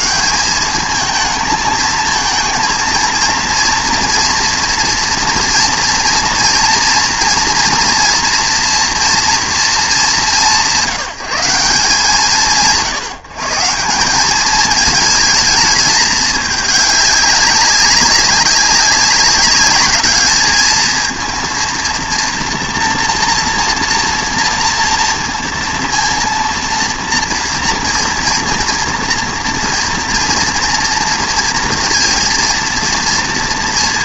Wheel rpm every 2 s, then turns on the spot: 220, 230, 230, 230, 230, 170, 140, 210, 210, 200, 220, 230, 240, 230, 240, 230, 230.
none